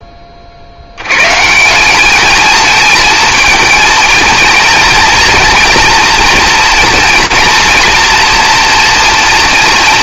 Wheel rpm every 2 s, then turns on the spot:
50, 220, 230, 230, 230.
none